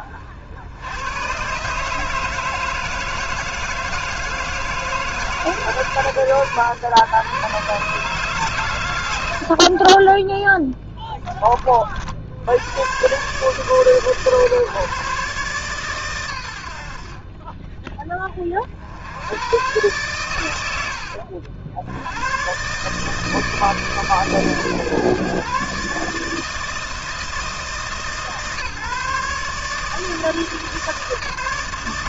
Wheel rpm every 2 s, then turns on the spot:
50, 150, 160, 130, 140, 30, 70, 140, 120, 20, 110, 100, 140, 150, 140, 160.
none